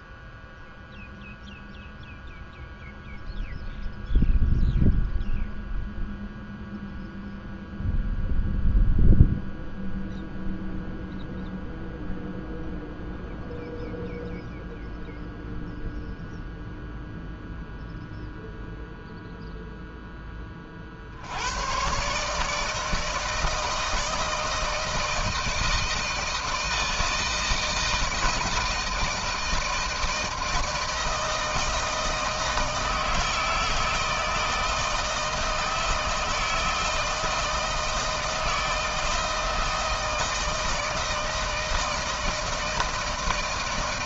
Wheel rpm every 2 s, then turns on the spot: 0, 0, 0, 0, 0, 0, 0, 0, 0, 0, 40, 150, 160, 160, 160, 160, 160, 160, 160, 160, 160, 160.
none